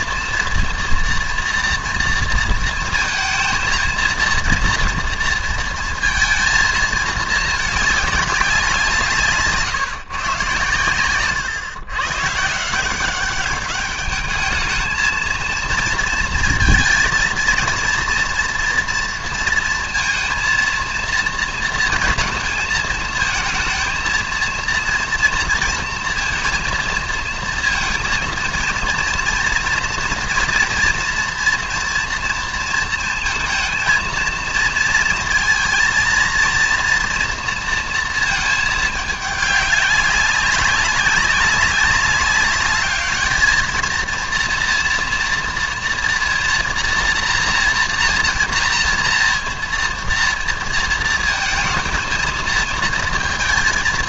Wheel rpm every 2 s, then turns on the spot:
230, 220, 230, 220, 180, 120, 160, 220, 230, 230, 230, 220, 230, 230, 230, 230, 230, 230, 230, 220, 200, 200, 230, 240, 230, 230, 230.
none